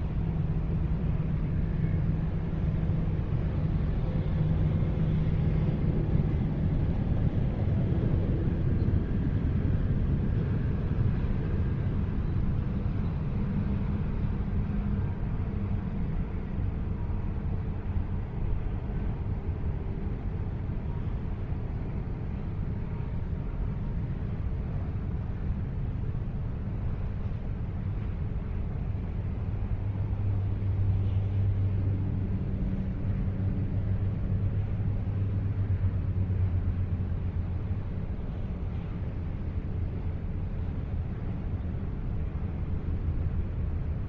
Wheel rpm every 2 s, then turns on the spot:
0, 0, 0, 0, 0, 0, 0, 0, 0, 0, 0, 0, 0, 0, 0, 0, 0, 0, 0, 0, 0, 0.
none